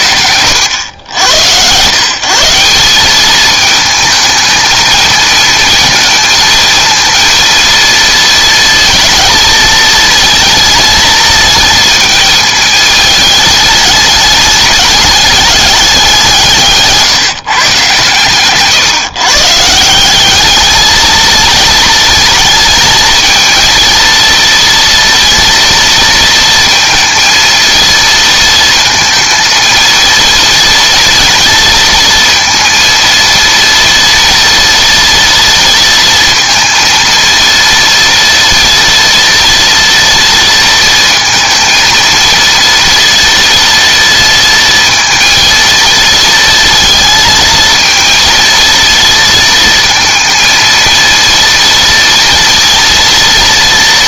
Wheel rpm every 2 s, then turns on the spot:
90, 180, 220, 230, 230, 220, 220, 210, 160, 140, 210, 230, 230, 230, 230, 230, 230, 230, 230, 230, 230, 230, 230, 230, 230, 230, 230.
none